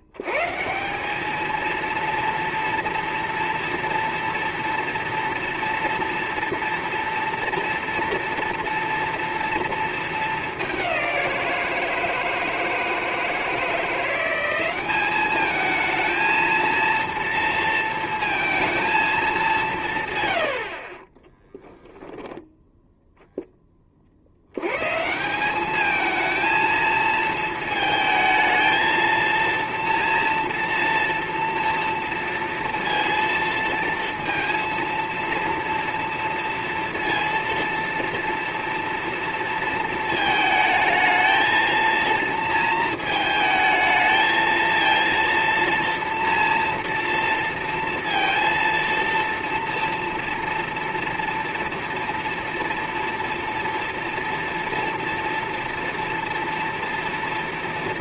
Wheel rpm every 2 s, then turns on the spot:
90, 230, 230, 230, 230, 210, 160, 190, 230, 230, 110, 0, 80, 220, 220, 230, 230, 230, 230, 230, 220, 230, 220, 230, 230, 230, 230, 230, 230.
none